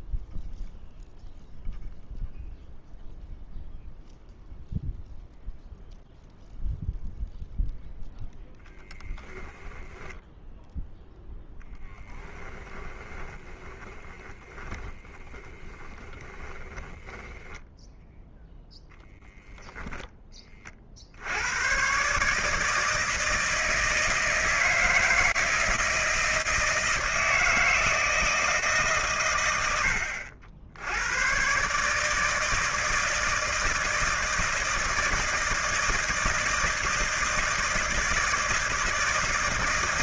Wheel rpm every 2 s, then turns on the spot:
0, 0, 0, 0, 0, 0, 30, 20, 10, 10, 50, 160, 160, 160, 150, 80, 160, 160, 160, 160.
12-20